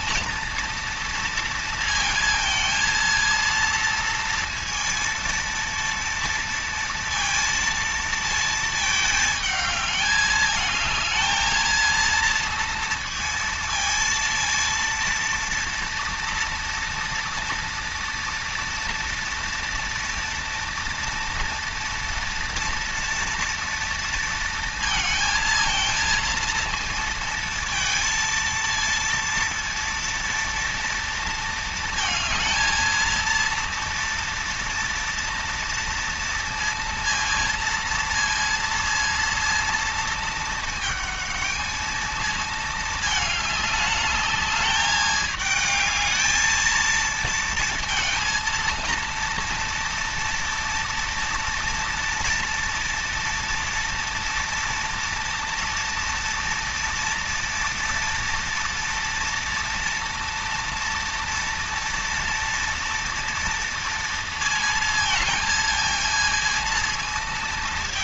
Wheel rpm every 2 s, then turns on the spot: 230, 230, 230, 230, 220, 220, 230, 230, 230, 230, 230, 230, 230, 230, 230, 230, 230, 230, 230, 230, 220, 220, 210, 220, 230, 230, 240, 230, 230, 230, 230, 230, 230, 230.
none